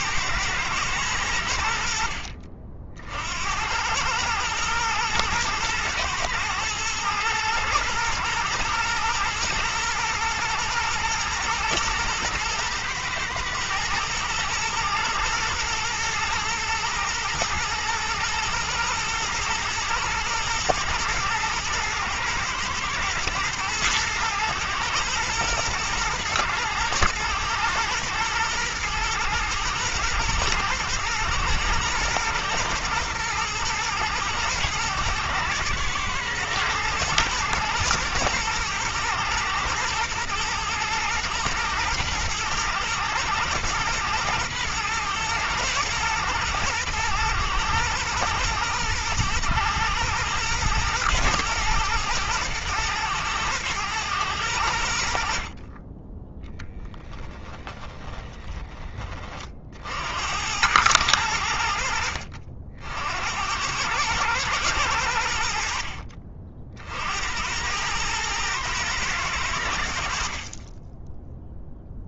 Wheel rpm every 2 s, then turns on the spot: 100, 60, 120, 120, 120, 110, 110, 110, 120, 110, 110, 110, 110, 110, 120, 120, 110, 110, 110, 110, 110, 110, 120, 120, 120, 110, 110, 80, 20, 30, 100, 80, 80, 70, 110, 20.
56-58